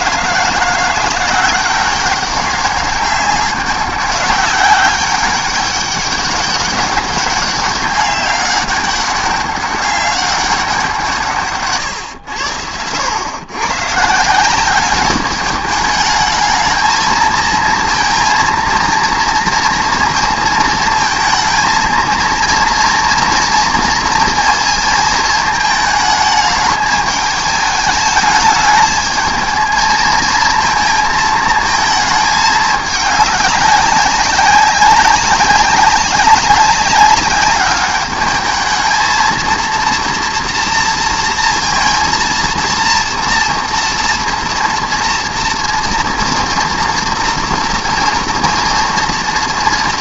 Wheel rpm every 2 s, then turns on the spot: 170, 200, 190, 200, 200, 190, 90, 190, 220, 230, 230, 230, 230, 210, 210, 220, 210, 190, 190, 220, 230, 230, 230, 230, 230.
none